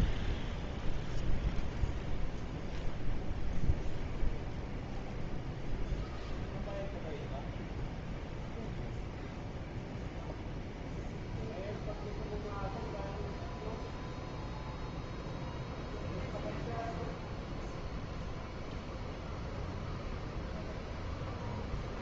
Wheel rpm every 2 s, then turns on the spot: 0, 0, 0, 0, 0, 0, 0, 0, 0, 0, 0.
none